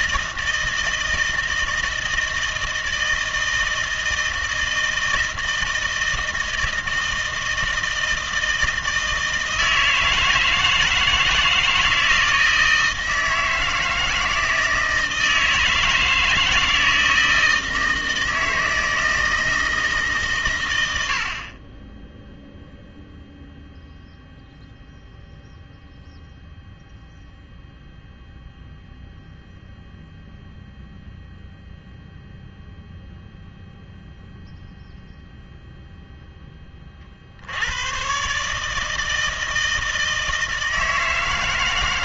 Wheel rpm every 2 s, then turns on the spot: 160, 160, 160, 160, 160, 160, 160, 160, 160, 160, 110, 0, 0, 0, 0, 0, 0, 0, 30, 160, 160.
none